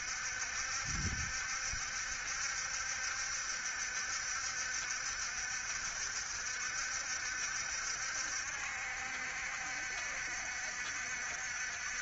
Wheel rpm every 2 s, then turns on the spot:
70, 70, 70, 70, 70, 60.
none